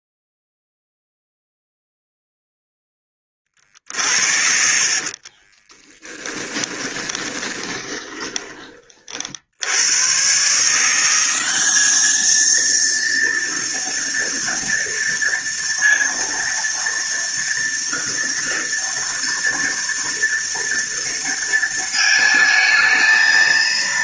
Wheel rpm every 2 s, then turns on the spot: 0, 10, 70, 20, 30, 150, 220, 230, 230, 230, 230, 220.
6-8